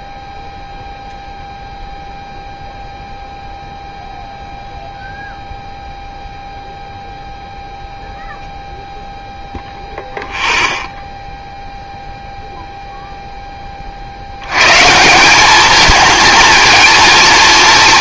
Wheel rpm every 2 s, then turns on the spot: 0, 0, 0, 0, 0, 0, 0, 120, 230.
none